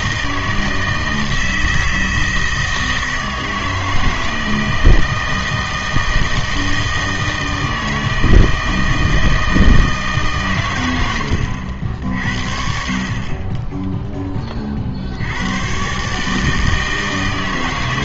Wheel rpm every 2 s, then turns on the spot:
160, 160, 160, 160, 160, 130, 60, 30, 160.
none